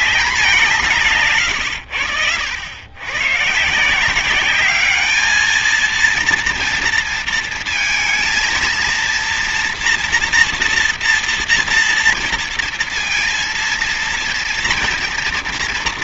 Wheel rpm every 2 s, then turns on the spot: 180, 90, 200, 230, 230, 230, 230, 230.
none